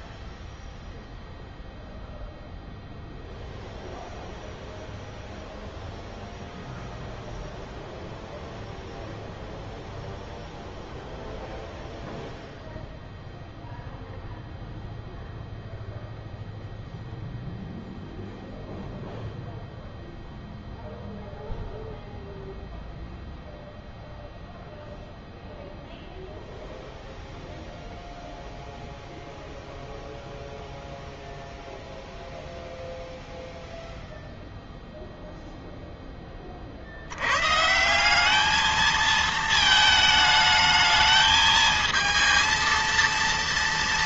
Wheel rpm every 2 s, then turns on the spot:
0, 0, 0, 0, 0, 0, 0, 0, 0, 0, 0, 0, 0, 0, 0, 0, 0, 0, 40, 210, 220, 230.
none